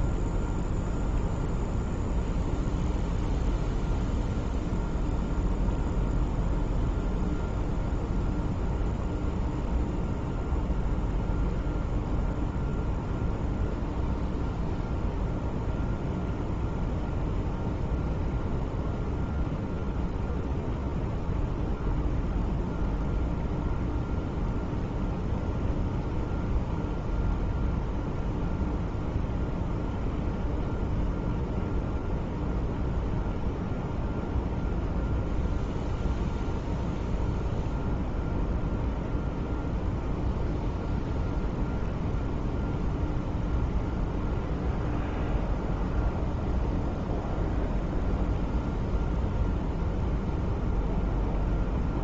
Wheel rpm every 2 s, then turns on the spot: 0, 0, 0, 0, 0, 0, 0, 0, 0, 0, 0, 0, 0, 0, 0, 0, 0, 0, 0, 0, 0, 0, 0, 0, 0, 0.
none